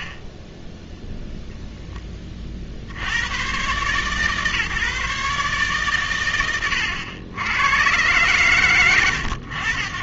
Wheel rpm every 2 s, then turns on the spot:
30, 50, 140, 110, 110.
none